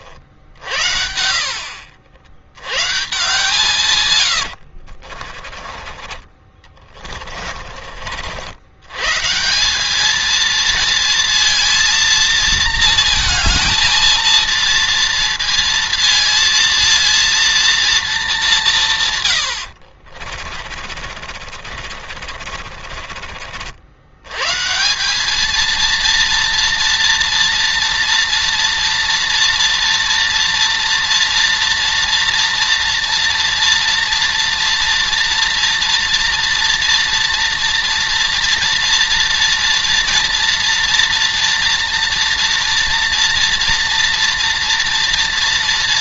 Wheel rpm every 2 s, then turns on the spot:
60, 120, 80, 30, 80, 230, 230, 230, 230, 180, 50, 40, 150, 230, 230, 230, 230, 240, 240, 230, 230, 230, 230.
4-8 20-24